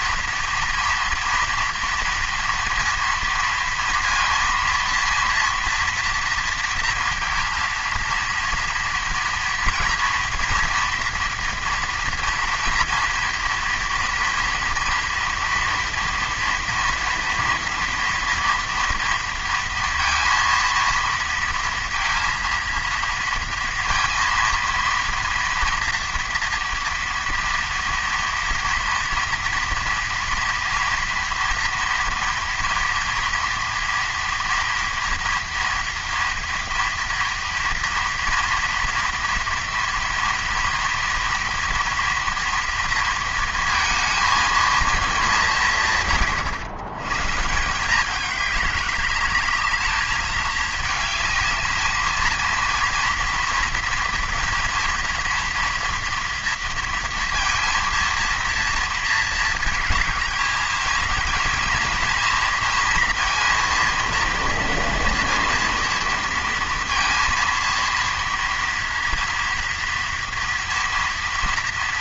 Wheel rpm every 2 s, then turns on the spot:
240, 230, 230, 230, 230, 240, 230, 230, 230, 230, 230, 230, 230, 230, 230, 230, 230, 230, 230, 230, 230, 230, 220, 110, 200, 220, 230, 230, 230, 230, 220, 230, 230, 230, 230, 230.
none